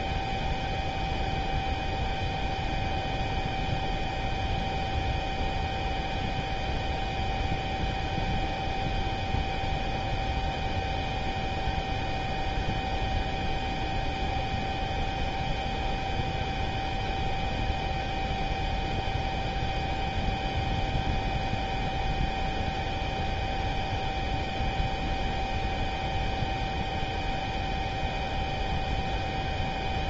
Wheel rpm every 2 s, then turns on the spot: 0, 0, 0, 0, 0, 0, 0, 0, 0, 0, 0, 0, 0, 0, 0.
none